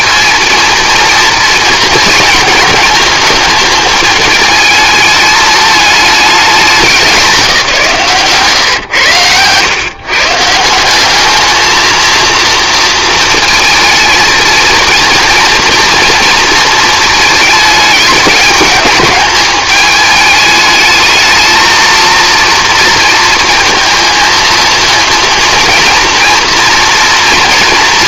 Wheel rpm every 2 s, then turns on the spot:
230, 230, 210, 210, 130, 170, 230, 220, 220, 210, 210, 230, 230, 230.
none